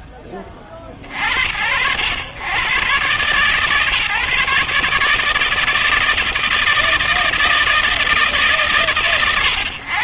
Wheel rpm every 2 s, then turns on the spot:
50, 120, 150, 160, 120.
none